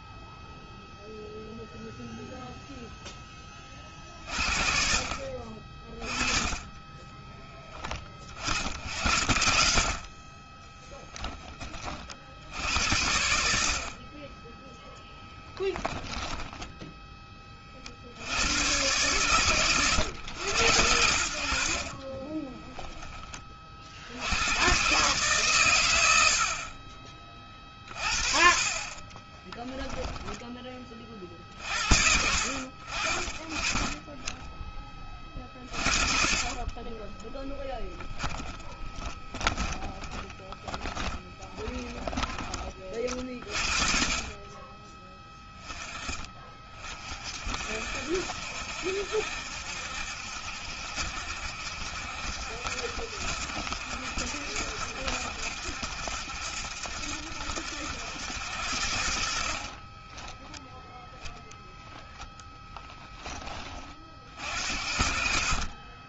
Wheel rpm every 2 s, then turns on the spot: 0, 0, 40, 20, 50, 20, 70, 10, 10, 120, 120, 10, 120, 50, 30, 30, 50, 20, 30, 10, 10, 30, 20, 40, 70, 70, 70, 70, 70, 70, 0, 20, 60.
10-12 28-30 38-42 62-64